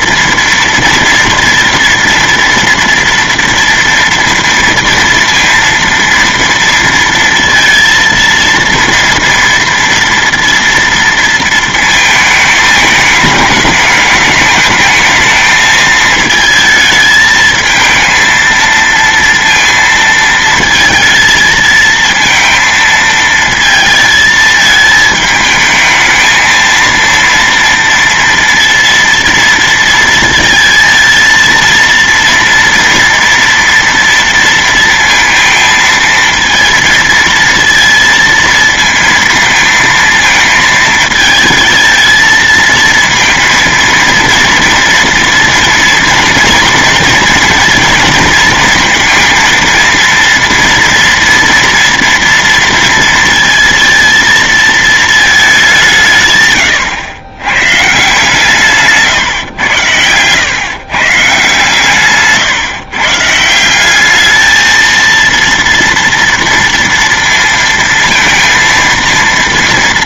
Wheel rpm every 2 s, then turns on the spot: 230, 230, 230, 230, 230, 230, 220, 210, 220, 230, 220, 230, 220, 220, 230, 230, 230, 230, 230, 230, 220, 230, 230, 230, 220, 230, 230, 230, 130, 150, 130, 150, 220, 230, 230.
none